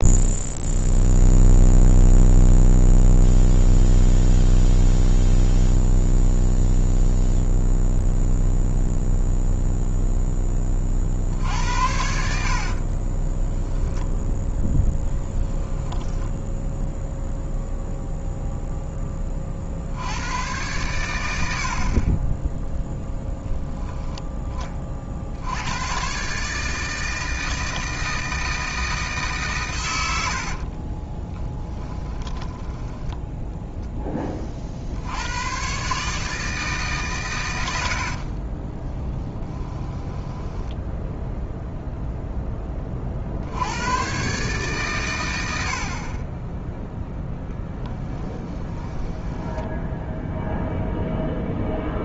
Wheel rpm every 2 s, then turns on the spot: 0, 0, 0, 0, 0, 30, 40, 0, 0, 10, 100, 0, 30, 150, 160, 40, 10, 50, 150, 10, 10, 20, 140, 10, 10, 0.
12-14 30-34 38-42 48-50